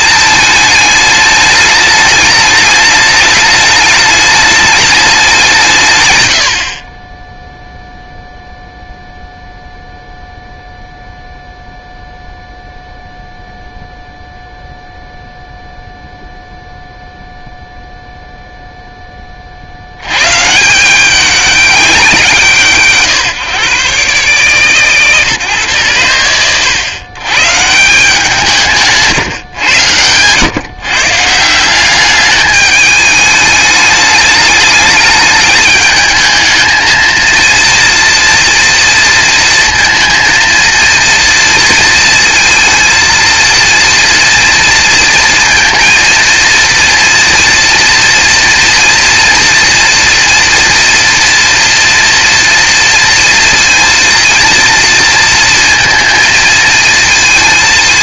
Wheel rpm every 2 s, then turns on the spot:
220, 210, 210, 70, 0, 0, 0, 0, 0, 0, 170, 150, 130, 100, 190, 120, 210, 210, 220, 230, 230, 230, 230, 230, 230, 230, 230, 230, 230.
none